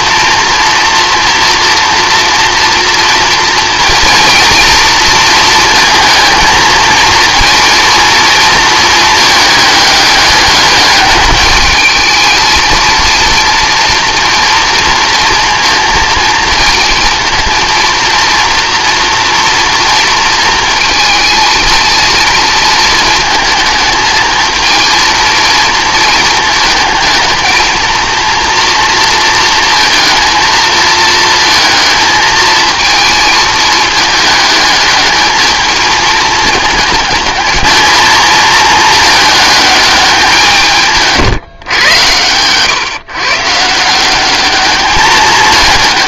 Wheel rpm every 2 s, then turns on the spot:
230, 230, 240, 220, 230, 200, 220, 230, 230, 230, 230, 220, 220, 220, 230, 220, 220, 220, 210, 220, 170, 120, 200.
none